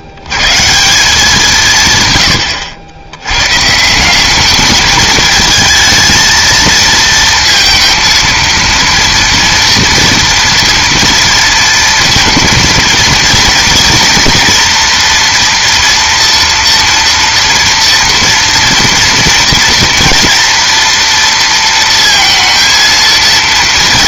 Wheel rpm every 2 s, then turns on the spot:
100, 110, 210, 230, 230, 230, 230, 240, 230, 230, 240, 230.
none